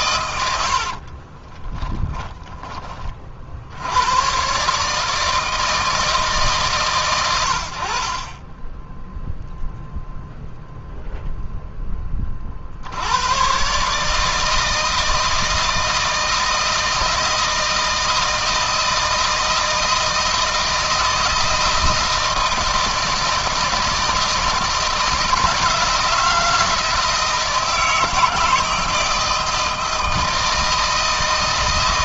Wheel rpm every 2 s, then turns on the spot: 50, 30, 150, 140, 10, 0, 70, 160, 160, 160, 160, 160, 160, 160, 160, 160.
0-2